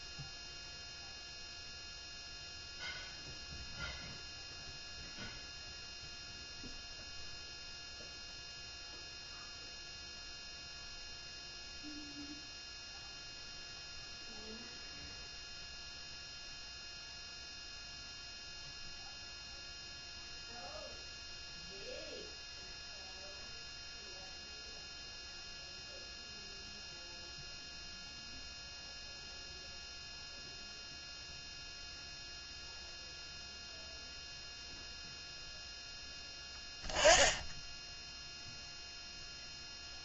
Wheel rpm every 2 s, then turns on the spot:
0, 0, 0, 0, 0, 0, 0, 0, 0, 0, 0, 0, 0, 0, 0, 0, 0, 0, 10, 0.
none